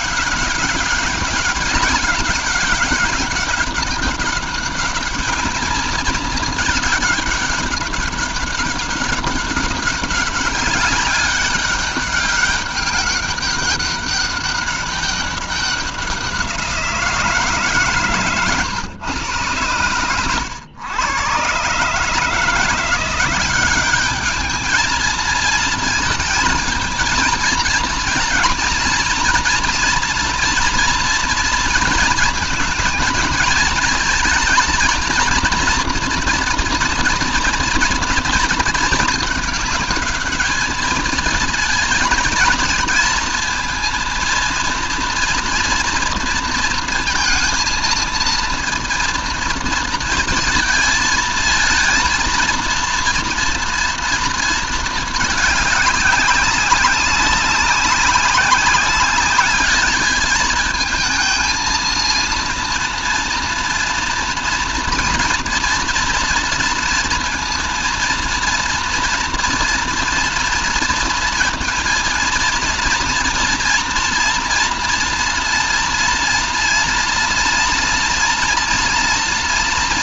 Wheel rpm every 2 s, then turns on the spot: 200, 200, 200, 210, 200, 200, 200, 200, 180, 130, 110, 160, 210, 220, 230, 240, 230, 230, 240, 220, 210, 230, 230, 230, 230, 230, 230, 230, 190, 200, 220, 230, 240, 230, 230, 230, 230, 230, 230, 230.
none